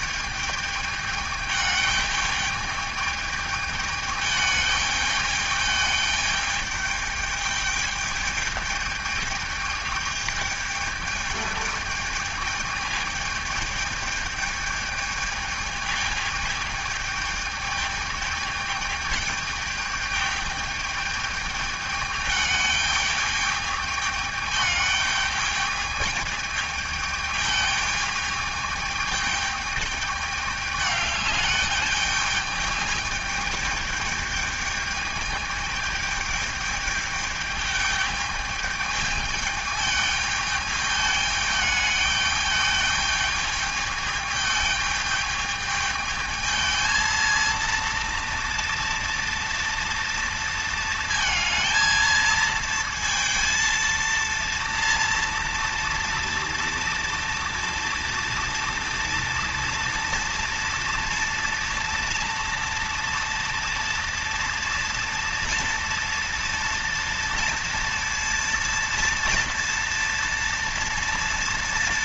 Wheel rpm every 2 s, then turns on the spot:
210, 210, 210, 210, 210, 210, 210, 210, 210, 210, 210, 210, 210, 210, 210, 210, 210, 210, 210, 210, 210, 210, 210, 220, 230, 230, 230, 230, 230, 230, 230, 230, 230, 230, 230, 240.
none